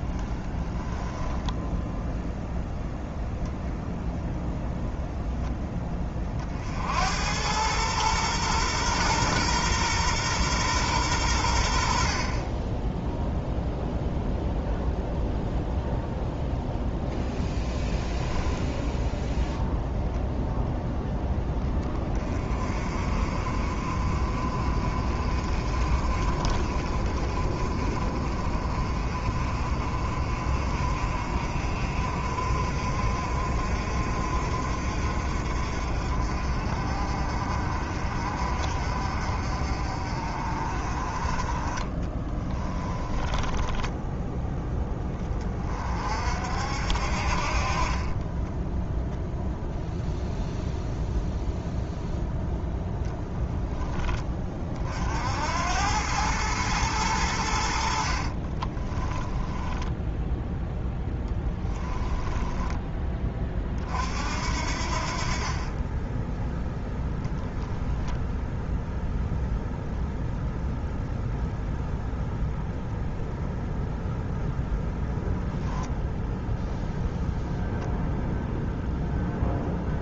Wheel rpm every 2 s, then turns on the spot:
20, 0, 0, 60, 120, 120, 20, 0, 0, 0, 0, 40, 40, 30, 40, 50, 50, 50, 50, 50, 40, 20, 10, 60, 0, 0, 0, 50, 110, 20, 10, 10, 60, 10, 0, 0, 0, 0, 0, 0.
0-2 42-44 58-60 62-64